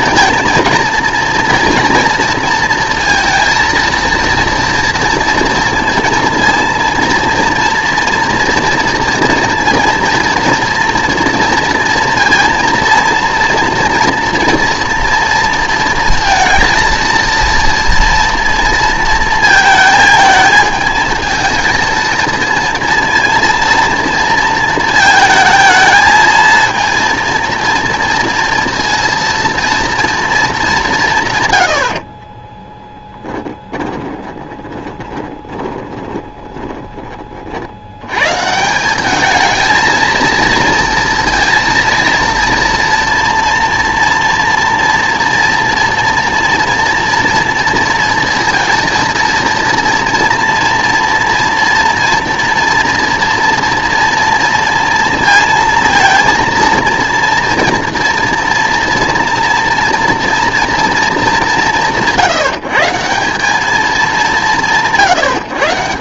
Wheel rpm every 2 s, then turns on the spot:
230, 230, 230, 230, 230, 230, 230, 230, 230, 230, 220, 230, 230, 230, 230, 210, 20, 20, 20, 160, 230, 230, 230, 240, 230, 230, 230, 230, 230, 230, 230, 150, 200.
32-38